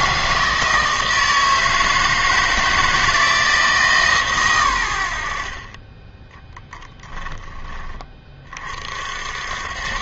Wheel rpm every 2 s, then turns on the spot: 160, 160, 110, 10, 40.
none